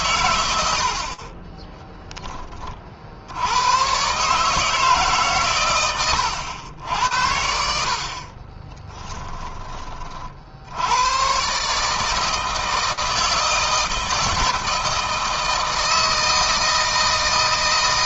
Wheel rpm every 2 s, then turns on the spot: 70, 50, 150, 80, 20, 90, 160, 160, 160.
8-10